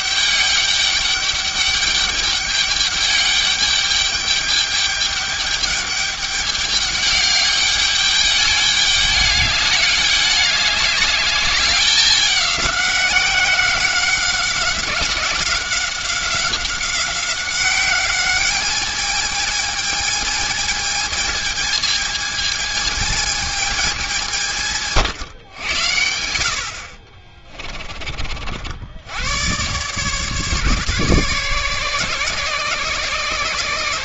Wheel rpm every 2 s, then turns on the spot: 200, 210, 210, 200, 210, 200, 200, 190, 190, 210, 210, 220, 150, 70, 70, 150, 140.
none